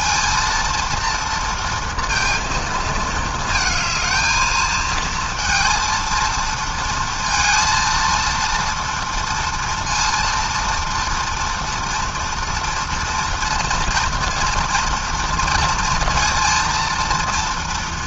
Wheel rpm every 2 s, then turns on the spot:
230, 230, 220, 230, 230, 230, 230, 230, 230.
none